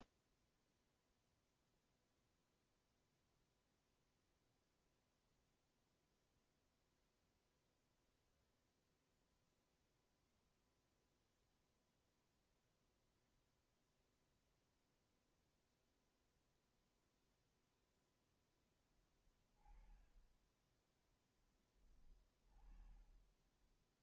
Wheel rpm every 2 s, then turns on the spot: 0, 0, 0, 0, 0, 0, 0, 0, 0, 10, 10, 20.
22-24